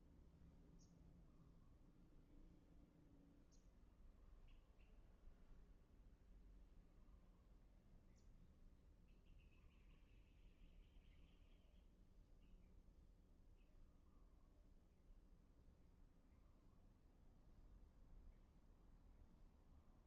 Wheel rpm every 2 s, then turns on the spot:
0, 0, 0, 0, 0, 0, 0, 0, 0, 0.
none